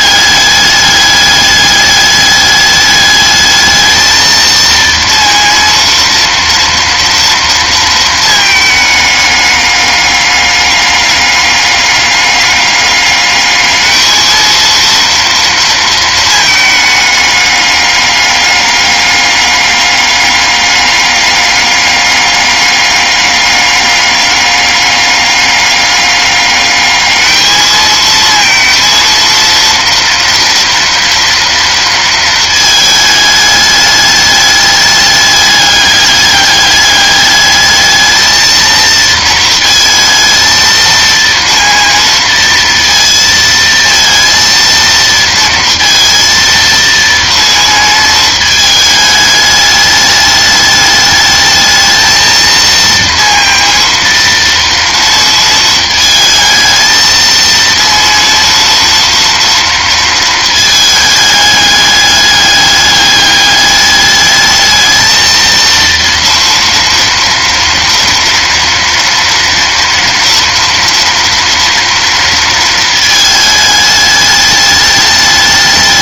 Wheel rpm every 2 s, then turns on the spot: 210, 210, 230, 230, 220, 200, 200, 220, 220, 200, 200, 200, 200, 210, 230, 230, 220, 210, 200, 230, 230, 230, 230, 230, 220, 210, 230, 230, 220, 230, 220, 200, 210, 230, 230, 230, 230, 210.
none